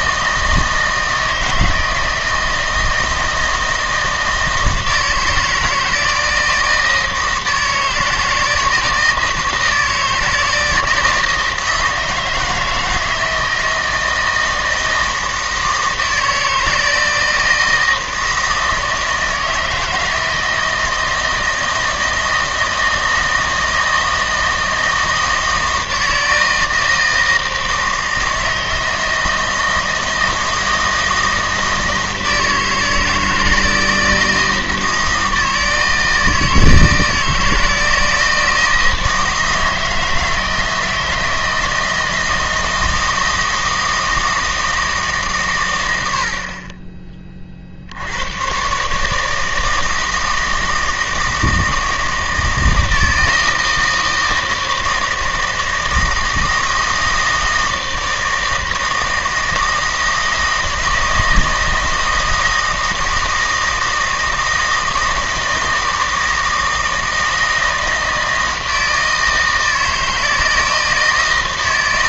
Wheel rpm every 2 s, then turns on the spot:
160, 160, 160, 160, 160, 160, 160, 160, 160, 160, 160, 160, 160, 160, 160, 160, 160, 160, 160, 160, 160, 160, 160, 30, 130, 160, 160, 160, 160, 160, 160, 160, 160, 160, 160, 160.
none